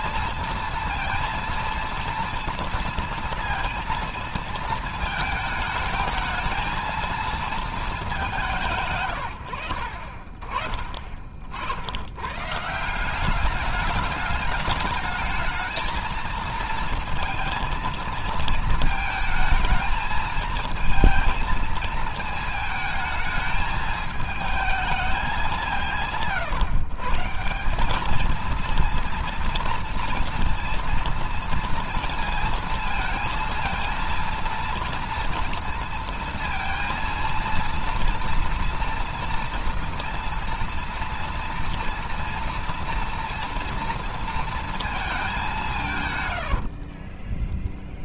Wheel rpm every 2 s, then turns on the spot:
230, 230, 220, 230, 160, 40, 150, 210, 230, 220, 220, 220, 220, 140, 230, 230, 230, 230, 230, 230, 230, 230, 230, 50.
46-48